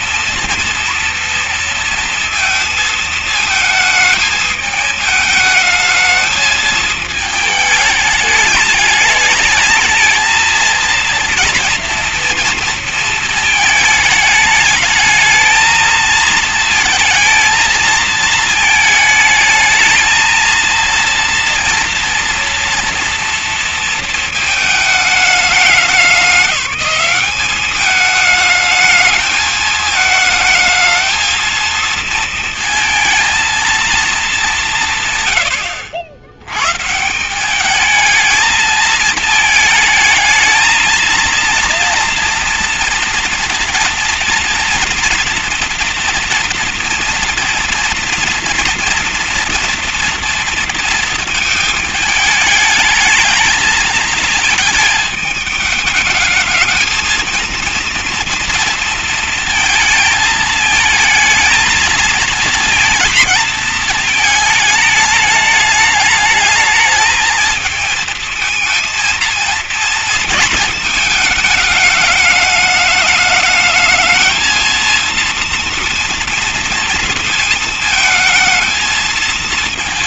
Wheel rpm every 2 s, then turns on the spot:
230, 230, 220, 220, 210, 230, 230, 220, 230, 220, 230, 230, 220, 200, 220, 220, 230, 200, 110, 220, 220, 230, 240, 230, 230, 240, 220, 220, 220, 230, 220, 230, 220, 220, 220, 230, 210, 220, 240, 230.
none